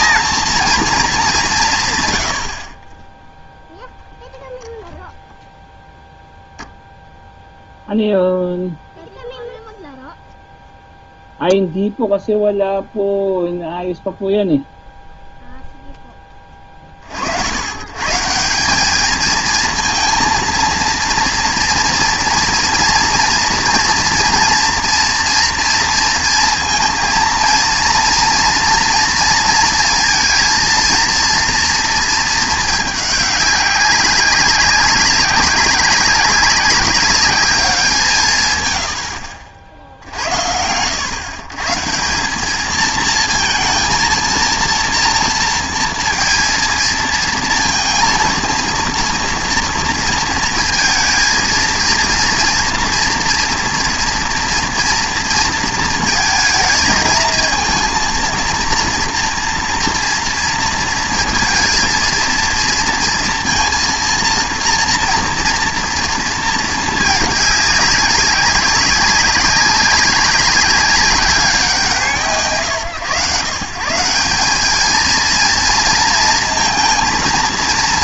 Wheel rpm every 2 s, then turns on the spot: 220, 40, 0, 0, 0, 0, 0, 0, 30, 190, 230, 230, 230, 230, 230, 230, 210, 190, 200, 110, 90, 210, 230, 230, 230, 230, 240, 230, 230, 230, 230, 230, 230, 220, 200, 200, 150, 210, 230.
none